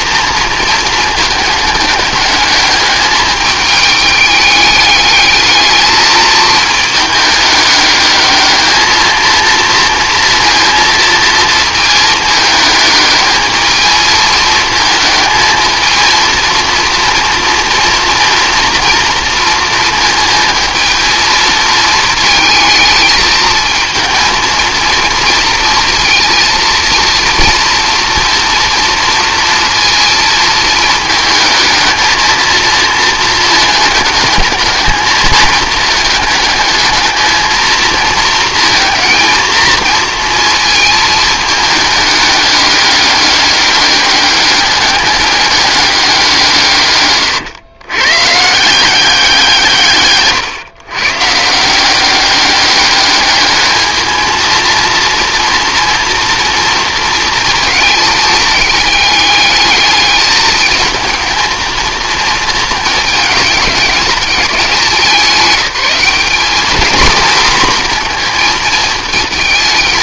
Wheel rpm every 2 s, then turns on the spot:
230, 210, 210, 220, 220, 230, 210, 220, 230, 230, 220, 220, 230, 230, 230, 220, 230, 220, 220, 230, 220, 200, 200, 150, 180, 120, 200, 230, 230, 210, 220, 220, 190, 230, 220.
none